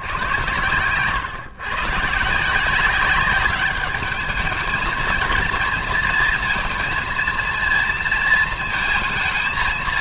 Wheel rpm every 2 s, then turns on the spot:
110, 180, 220, 230, 230.
0-2